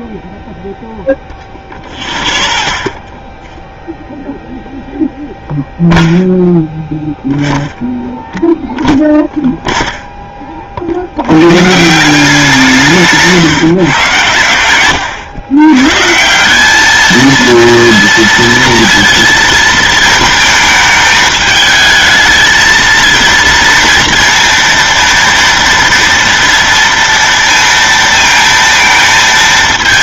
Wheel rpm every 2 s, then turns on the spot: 0, 0, 0, 0, 0, 40, 170, 100, 200, 230, 220, 220, 230, 230, 220.
none